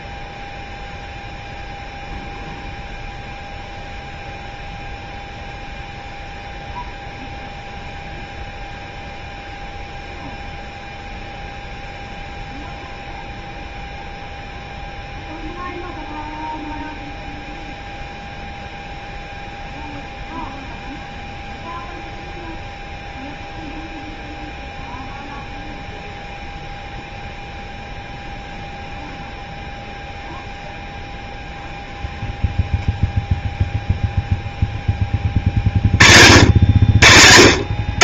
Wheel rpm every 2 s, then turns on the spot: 0, 0, 0, 0, 0, 0, 0, 0, 0, 0, 0, 0, 0, 0, 0, 0, 0, 0, 70.
none